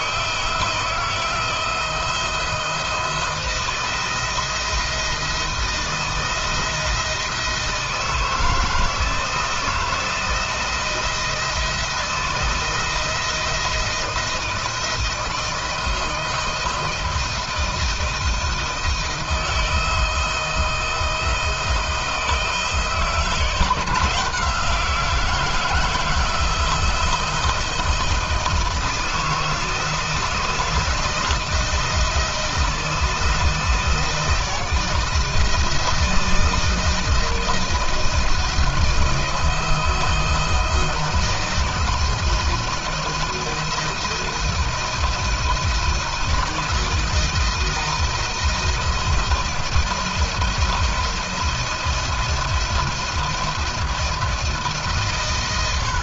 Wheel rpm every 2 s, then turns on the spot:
160, 170, 170, 160, 160, 160, 170, 160, 160, 160, 160, 160, 170, 160, 160, 160, 160, 160, 170, 160, 160, 170, 170, 170, 160, 160, 170, 140.
none